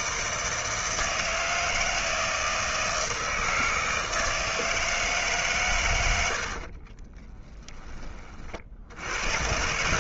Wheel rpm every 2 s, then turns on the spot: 160, 160, 160, 50, 60.
6-8